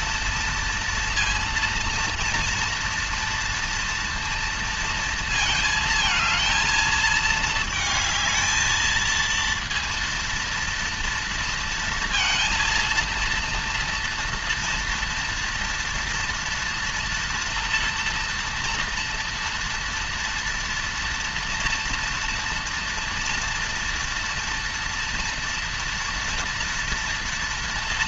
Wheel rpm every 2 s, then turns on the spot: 230, 230, 230, 220, 220, 230, 230, 230, 230, 230, 230, 230, 230, 230.
none